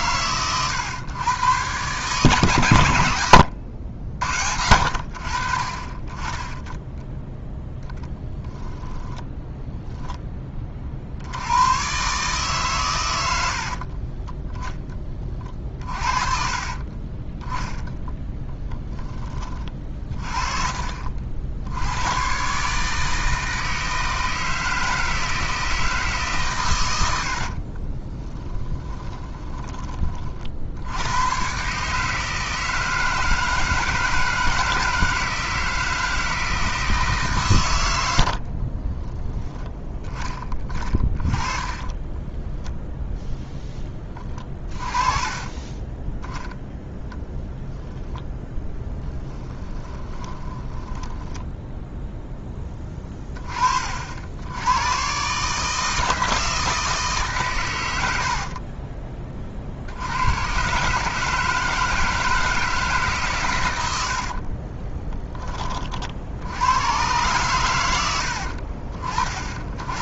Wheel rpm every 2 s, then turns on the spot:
120, 120, 70, 10, 0, 20, 140, 10, 40, 10, 40, 130, 160, 130, 10, 60, 160, 160, 160, 50, 30, 10, 30, 10, 10, 10, 10, 80, 160, 40, 120, 160, 40, 90, 60.
16-20 28-30 38-42 48-52 58-60 64-66